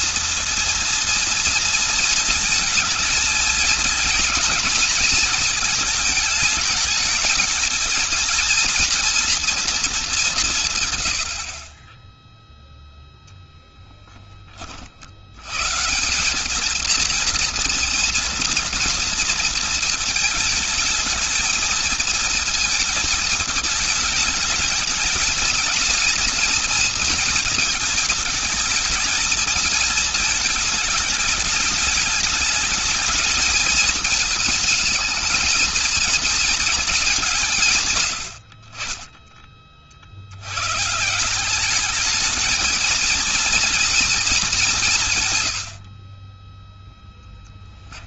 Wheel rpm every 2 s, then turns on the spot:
230, 220, 220, 220, 240, 160, 0, 40, 210, 230, 220, 220, 220, 230, 220, 210, 210, 220, 220, 50, 100, 220, 210, 20.
38-40 46-48